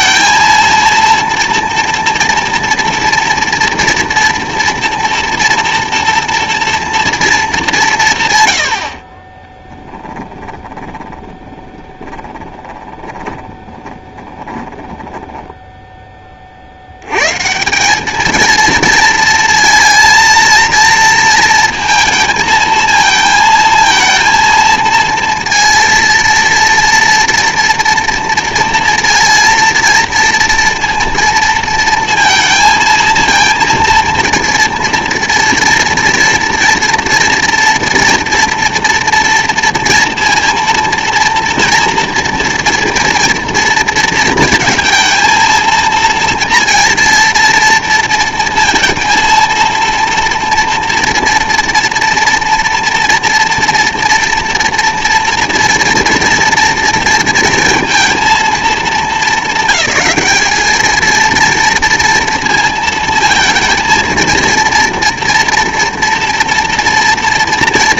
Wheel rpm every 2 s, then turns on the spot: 230, 230, 230, 240, 90, 20, 20, 10, 70, 220, 230, 230, 220, 230, 230, 230, 230, 230, 230, 230, 230, 230, 230, 230, 230, 230, 230, 230, 230, 210, 220, 230, 230, 230.
10-16